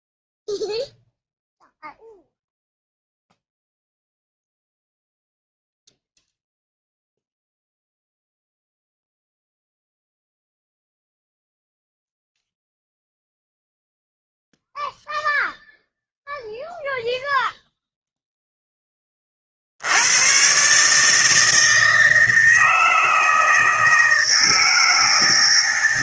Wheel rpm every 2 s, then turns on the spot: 0, 0, 0, 0, 0, 0, 0, 0, 0, 10, 130, 160, 160.
none